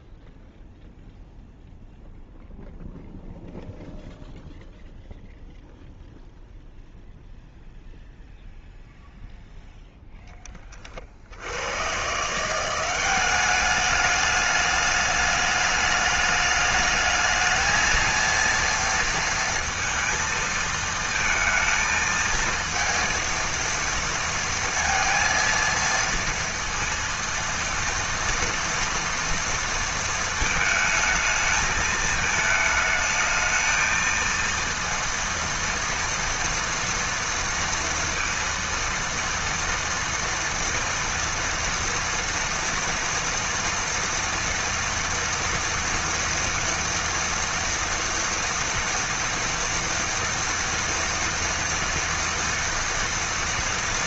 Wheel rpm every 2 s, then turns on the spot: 0, 0, 0, 0, 0, 10, 150, 210, 210, 230, 230, 230, 230, 230, 230, 220, 220, 230, 230, 230, 230, 230, 230, 230, 230, 230, 230.
none